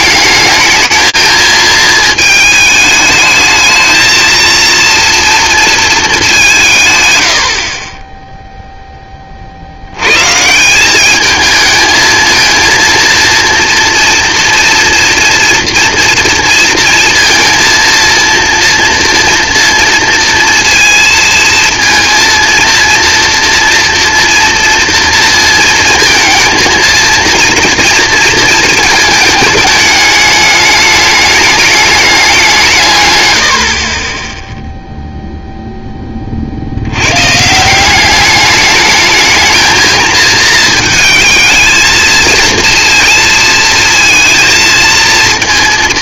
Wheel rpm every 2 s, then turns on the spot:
220, 220, 230, 160, 10, 180, 230, 230, 230, 230, 230, 230, 230, 230, 220, 210, 150, 0, 80, 210, 220, 230, 230.
none